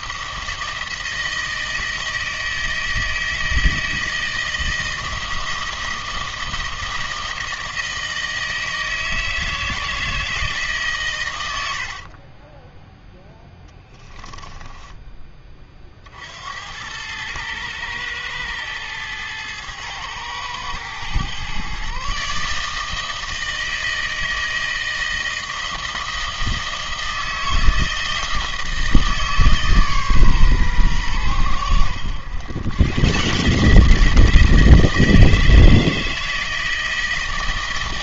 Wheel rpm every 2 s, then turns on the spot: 160, 160, 160, 160, 160, 160, 20, 10, 80, 110, 110, 150, 160, 160, 160, 130, 120, 160, 160.
12-16